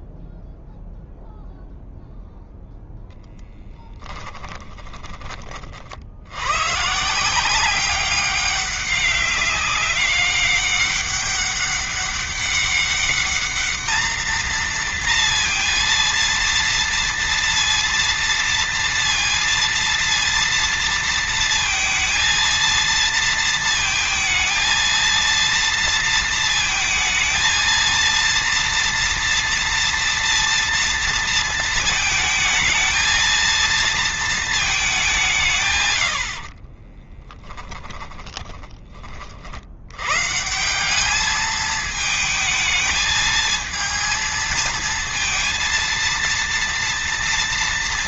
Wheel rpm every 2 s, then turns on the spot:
0, 0, 20, 150, 200, 200, 200, 230, 230, 230, 230, 230, 230, 230, 230, 230, 230, 200, 30, 30, 200, 220, 230, 230.
36-38